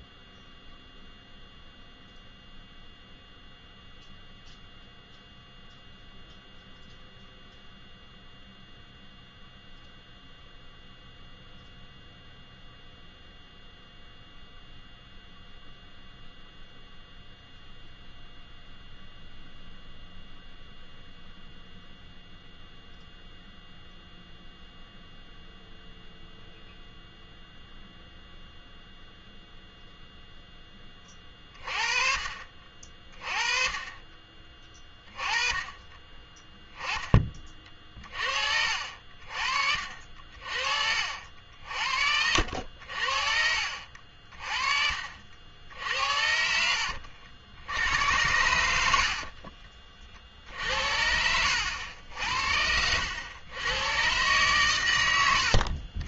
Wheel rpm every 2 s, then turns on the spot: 0, 0, 0, 0, 0, 0, 0, 0, 0, 0, 0, 0, 0, 0, 0, 30, 30, 20, 20, 50, 60, 50, 50, 70, 70, 70, 70, 110.
52-54